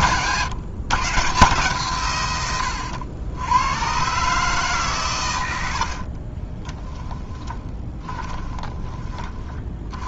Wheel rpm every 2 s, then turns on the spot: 150, 90, 130, 10, 20.
6-8